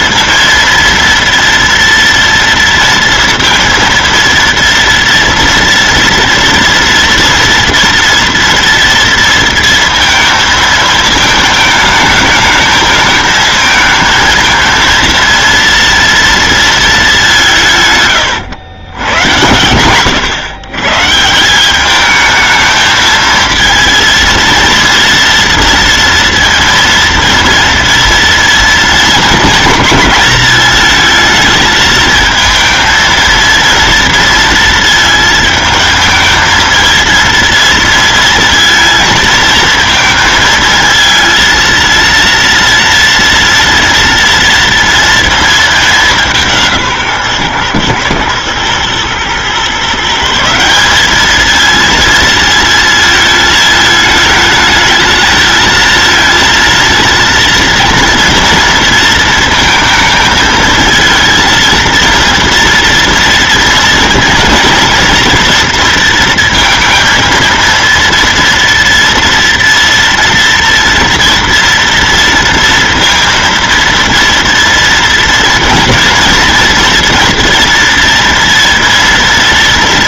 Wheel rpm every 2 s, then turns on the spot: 230, 240, 230, 230, 230, 230, 220, 220, 230, 120, 110, 210, 230, 230, 230, 220, 220, 230, 220, 230, 230, 230, 230, 190, 110, 160, 230, 220, 230, 230, 220, 230, 230, 230, 230, 230, 230, 230, 230, 230.
none